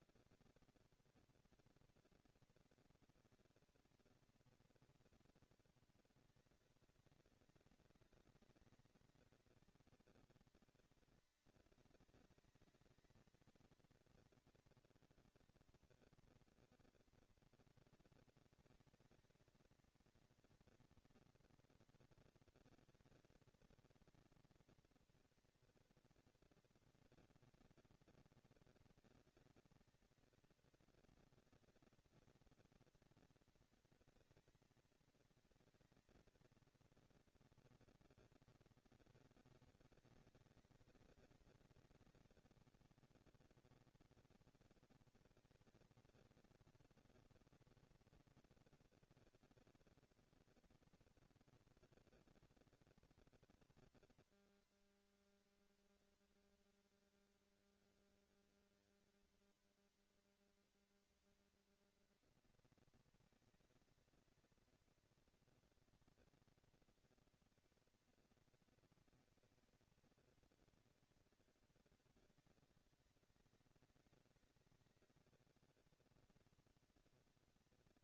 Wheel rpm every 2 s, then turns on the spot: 230, 230, 220, 200, 200, 220, 220, 230, 230, 220, 230, 230, 230, 230, 230, 230, 230, 230, 230, 210, 190, 210, 230, 230, 240, 230, 230, 230, 230, 230, 230, 230, 230, 220, 220, 220, 190, 190, 230.
none